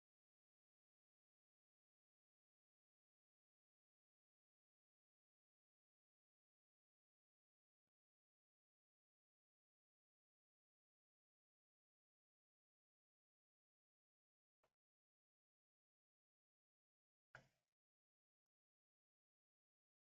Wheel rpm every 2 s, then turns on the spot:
0, 0, 0, 0, 0, 0, 0, 0, 0, 0.
none